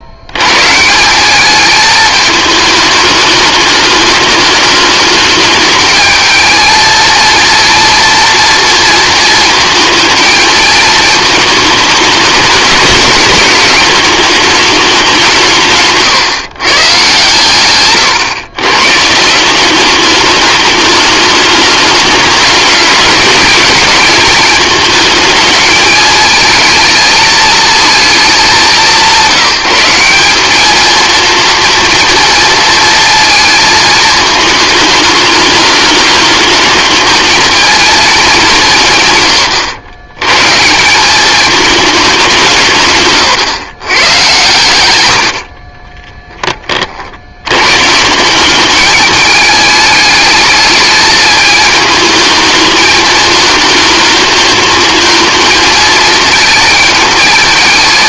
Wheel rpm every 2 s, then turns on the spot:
160, 210, 220, 230, 230, 220, 200, 200, 130, 140, 210, 210, 220, 220, 190, 220, 220, 220, 220, 160, 180, 150, 90, 50, 210, 220, 220, 220, 220.
42-44